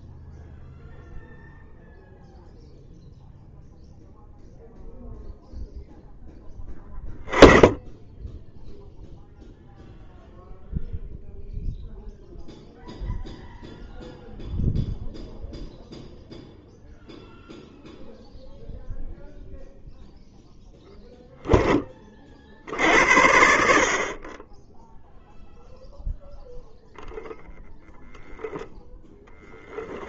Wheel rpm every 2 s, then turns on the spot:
0, 0, 0, 10, 0, 0, 0, 0, 0, 0, 0, 70, 0, 0, 0.
none